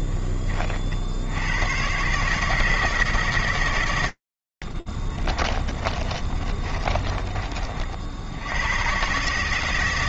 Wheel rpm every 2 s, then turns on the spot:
40, 150, 120, 30, 40.
6-8